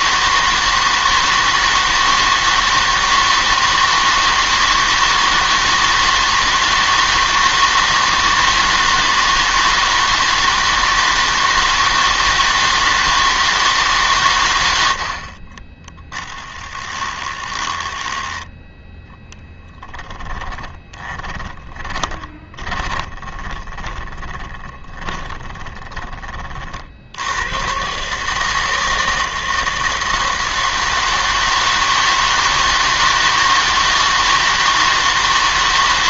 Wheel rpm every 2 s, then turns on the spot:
160, 160, 160, 160, 160, 160, 160, 100, 10, 10, 20, 20, 20, 40, 160, 160, 160, 160.
16-18 20-26